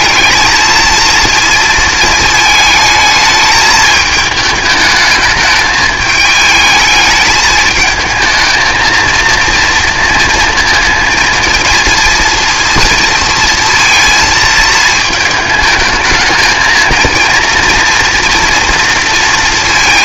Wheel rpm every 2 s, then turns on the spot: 230, 220, 220, 220, 220, 230, 230, 230, 220, 230.
none